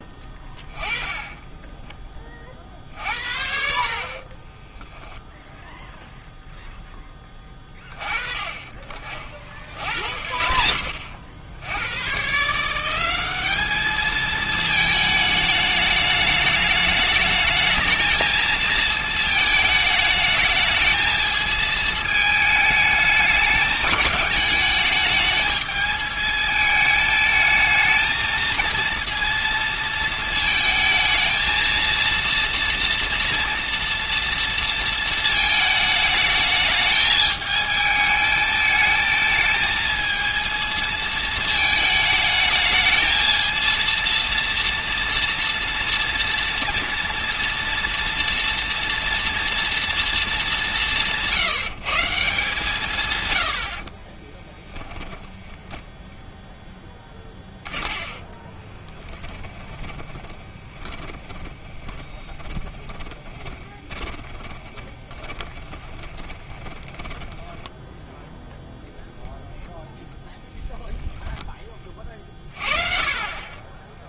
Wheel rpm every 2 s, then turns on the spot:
20, 50, 10, 0, 30, 50, 160, 220, 210, 220, 220, 220, 210, 220, 230, 220, 230, 230, 210, 220, 220, 220, 230, 230, 230, 200, 150, 10, 10, 10, 20, 20, 10, 20, 0, 0, 30.
4-6 54-68